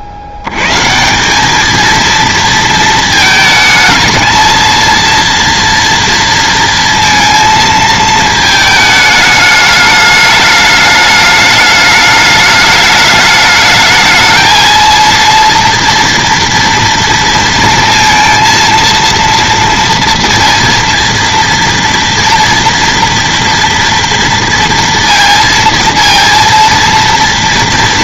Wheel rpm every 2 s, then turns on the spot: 100, 230, 220, 230, 220, 210, 210, 220, 230, 230, 230, 230, 230, 230.
none